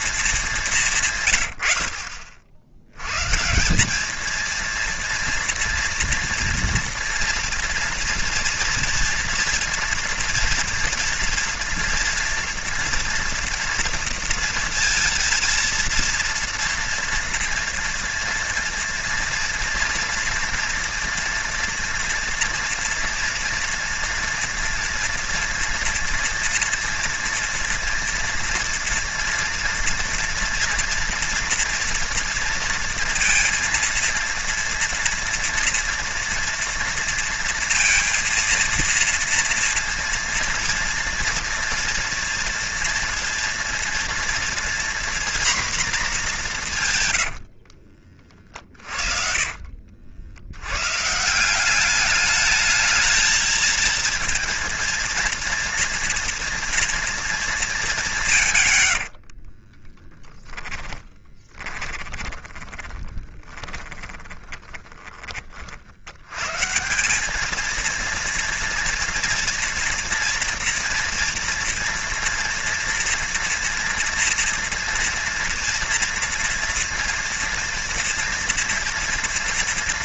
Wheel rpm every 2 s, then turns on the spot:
160, 90, 230, 240, 230, 230, 240, 230, 230, 230, 230, 230, 240, 240, 230, 230, 230, 230, 230, 230, 230, 230, 240, 170, 40, 110, 210, 230, 230, 110, 10, 20, 10, 150, 230, 240, 230, 230, 230, 230.
48-50 58-66